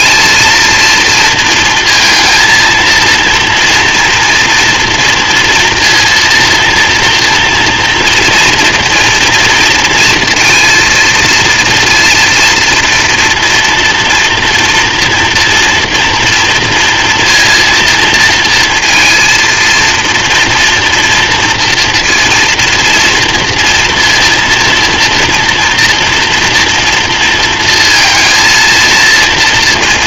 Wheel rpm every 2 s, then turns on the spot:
230, 230, 230, 230, 240, 230, 230, 230, 230, 230, 240, 230, 240, 230, 230.
none